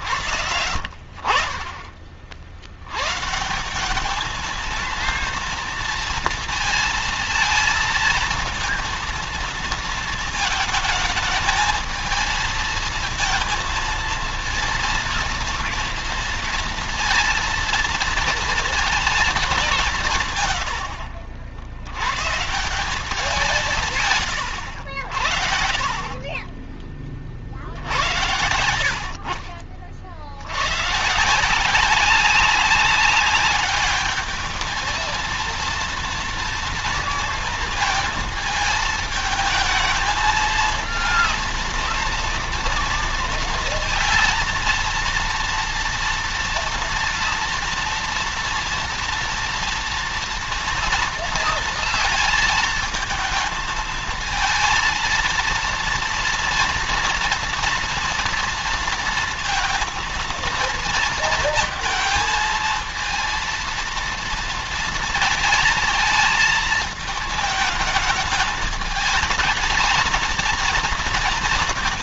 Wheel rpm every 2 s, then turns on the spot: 50, 100, 230, 230, 230, 210, 220, 230, 230, 230, 80, 170, 70, 30, 60, 120, 200, 220, 230, 220, 230, 230, 230, 230, 230, 230, 220, 230, 230, 230, 230, 230, 230, 220, 220, 230.
none